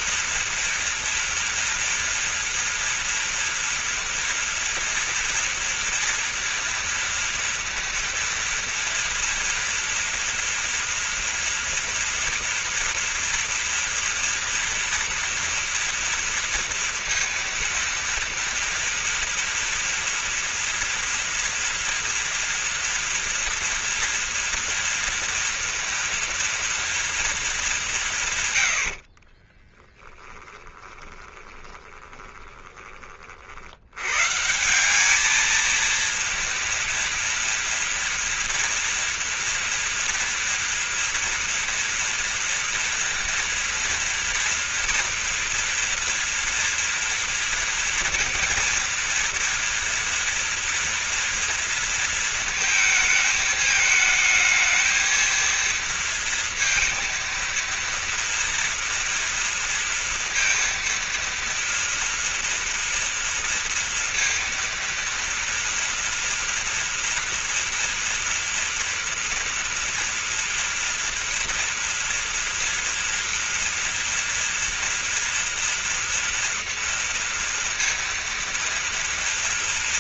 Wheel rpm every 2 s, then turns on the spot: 230, 230, 230, 230, 230, 230, 240, 240, 230, 230, 230, 230, 230, 240, 110, 20, 20, 170, 230, 230, 230, 230, 240, 230, 230, 230, 220, 220, 230, 230, 230, 230, 230, 230, 230, 240, 230, 230, 230, 230.
30-34